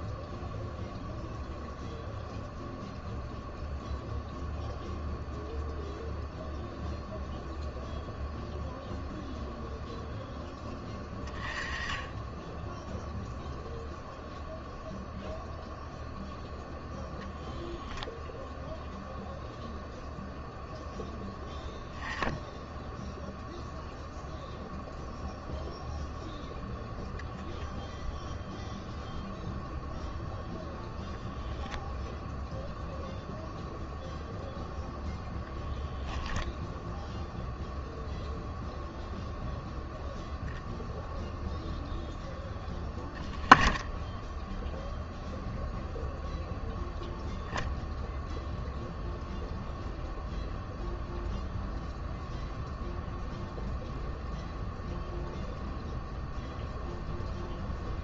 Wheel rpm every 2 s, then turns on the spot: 0, 0, 0, 0, 0, 20, 0, 0, 0, 0, 0, 0, 0, 0, 0, 0, 0, 0, 0, 0, 0, 10, 0, 0, 0, 0, 0, 0, 0.
none